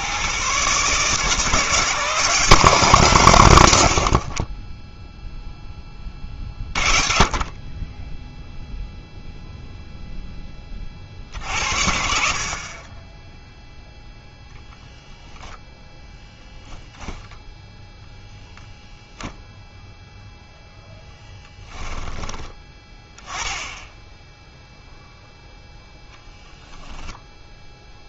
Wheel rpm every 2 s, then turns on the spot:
140, 150, 10, 40, 0, 40, 30, 0, 0, 0, 0, 20, 0, 0.
none